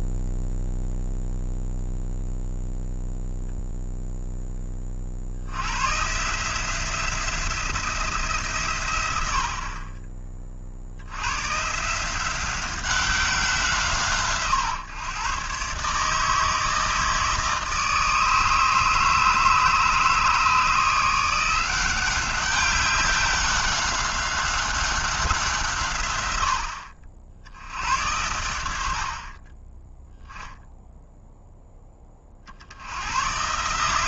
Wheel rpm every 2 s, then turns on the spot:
0, 0, 20, 170, 130, 50, 190, 130, 160, 150, 160, 190, 190, 70, 70, 0, 80.
none